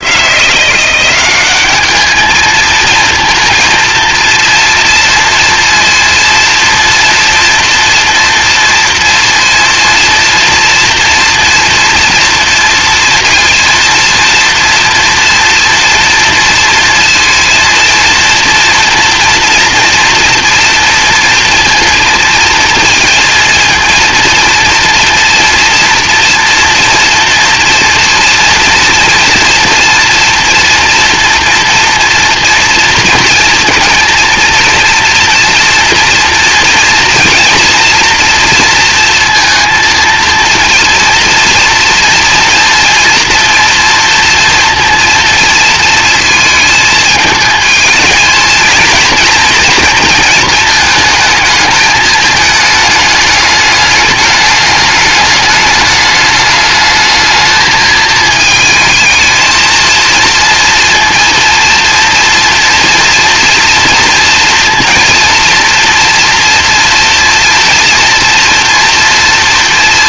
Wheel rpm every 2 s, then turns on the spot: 180, 220, 230, 230, 230, 230, 240, 230, 230, 230, 230, 230, 230, 230, 230, 230, 230, 230, 230, 230, 230, 230, 230, 220, 220, 220, 210, 210, 210, 220, 230, 240, 230, 230, 230.
none